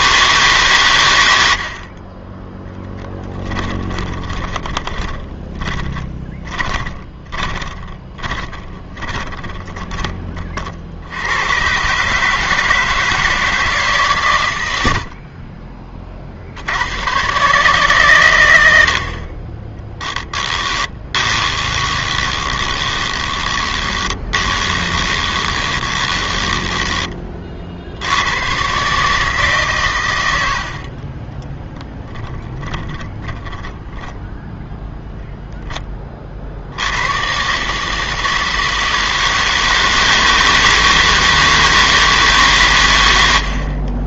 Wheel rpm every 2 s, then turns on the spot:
140, 10, 20, 20, 30, 40, 160, 100, 80, 90, 10, 20, 20, 10, 120, 70, 10, 0, 70, 160, 160, 130.
4-10 20-28 30-34